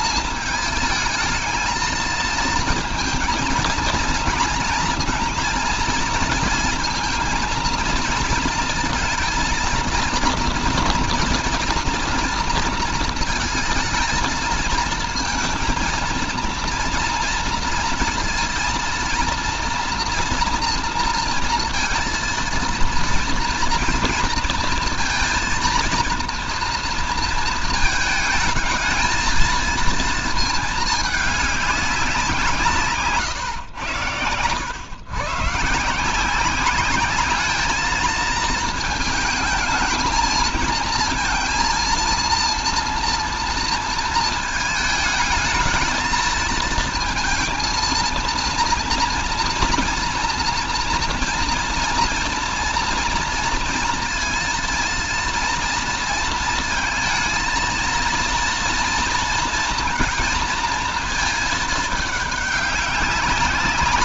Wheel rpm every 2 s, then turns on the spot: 220, 230, 230, 230, 230, 230, 230, 230, 230, 230, 230, 230, 230, 230, 220, 220, 160, 120, 200, 230, 230, 230, 220, 230, 230, 230, 230, 230, 220, 230, 230, 200.
none